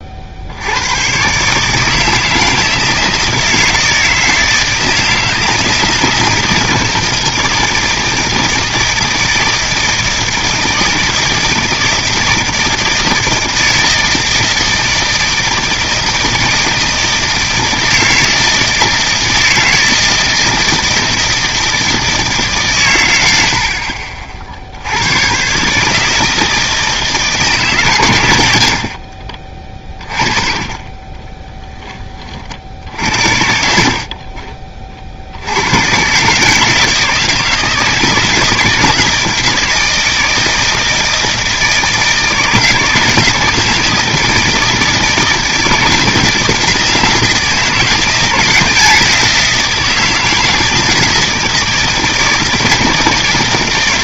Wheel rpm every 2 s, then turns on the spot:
100, 160, 160, 170, 160, 160, 160, 160, 160, 160, 160, 110, 90, 160, 60, 30, 60, 40, 160, 160, 160, 160, 160, 160, 170, 160, 160.
28-30